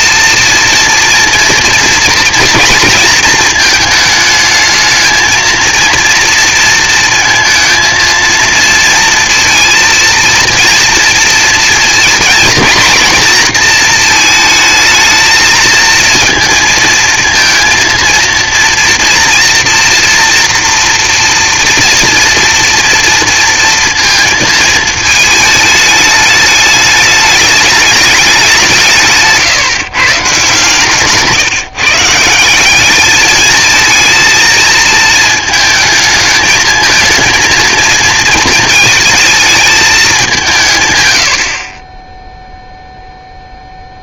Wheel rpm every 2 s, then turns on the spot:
230, 230, 220, 230, 230, 230, 230, 220, 230, 230, 240, 230, 220, 210, 180, 140, 180, 220, 220, 230, 160, 0.
none